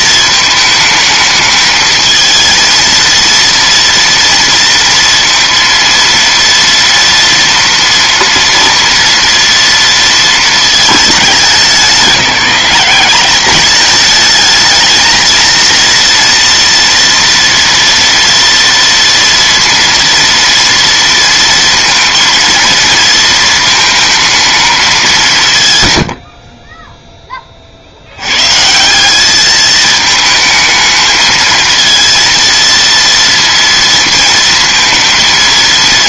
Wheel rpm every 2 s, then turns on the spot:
220, 220, 230, 230, 230, 220, 180, 220, 230, 230, 230, 230, 220, 40, 130, 220, 230, 230.
none